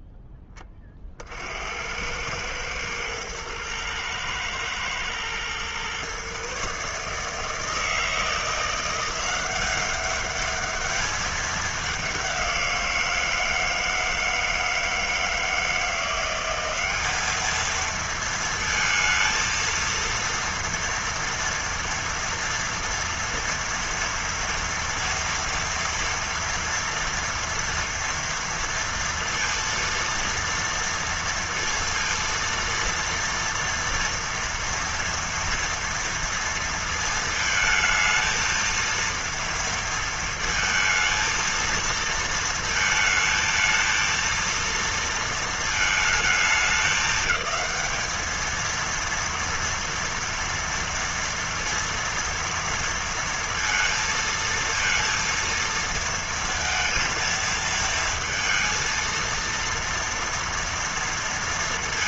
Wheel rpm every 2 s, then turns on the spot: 10, 100, 110, 130, 170, 200, 190, 160, 180, 230, 230, 230, 230, 230, 230, 230, 230, 230, 230, 230, 230, 230, 230, 210, 220, 230, 230, 230, 230, 230, 230.
none